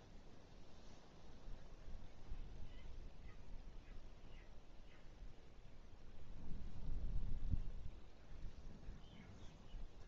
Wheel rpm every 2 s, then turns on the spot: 0, 0, 0, 0, 0.
none